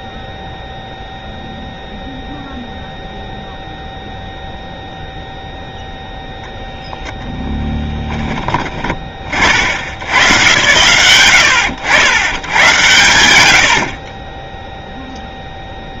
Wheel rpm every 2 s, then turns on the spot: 0, 0, 0, 0, 20, 120, 110, 10.
none